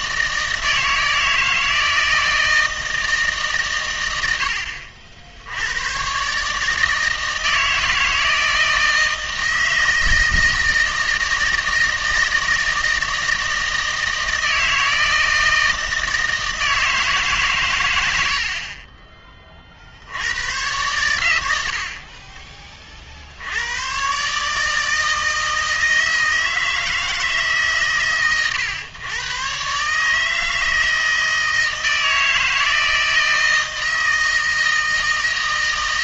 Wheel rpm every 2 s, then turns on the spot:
160, 160, 70, 150, 160, 160, 160, 160, 160, 40, 110, 40, 160, 160, 110, 160, 160, 160.
none